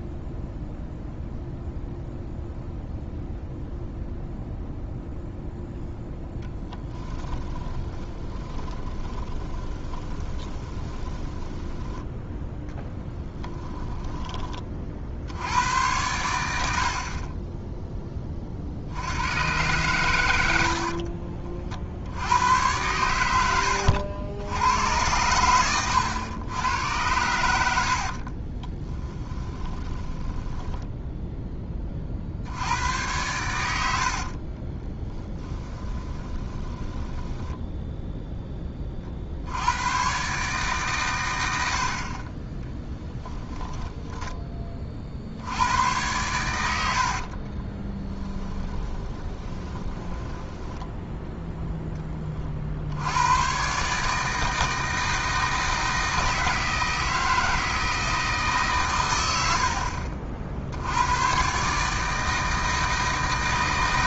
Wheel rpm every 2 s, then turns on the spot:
0, 0, 0, 10, 20, 20, 10, 40, 70, 70, 60, 100, 100, 90, 20, 10, 90, 20, 20, 20, 130, 20, 30, 90, 20, 10, 70, 160, 160, 130, 80, 160.
6-14 20-22 28-32 34-38 42-44 46-52